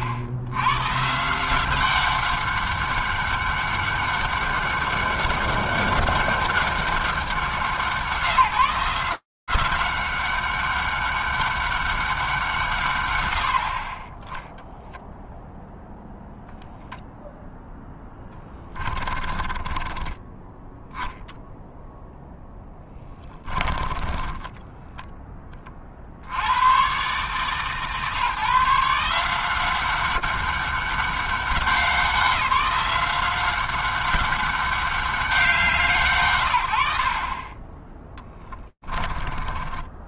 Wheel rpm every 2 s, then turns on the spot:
100, 200, 200, 200, 160, 200, 170, 0, 0, 10, 10, 10, 10, 80, 140, 200, 190, 200, 90, 10.
18-20 22-26 38-40